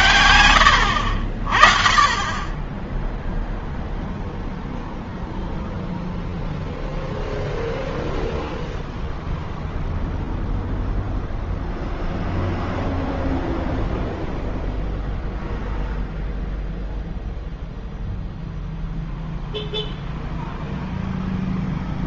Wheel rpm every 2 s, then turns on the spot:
60, 10, 0, 0, 0, 0, 0, 0, 0, 0, 0.
none